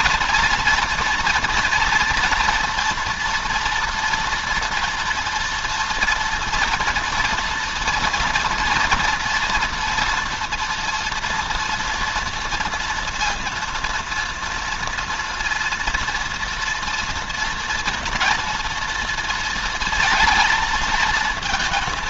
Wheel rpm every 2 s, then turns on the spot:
230, 230, 230, 230, 230, 230, 230, 230, 230, 230, 230.
none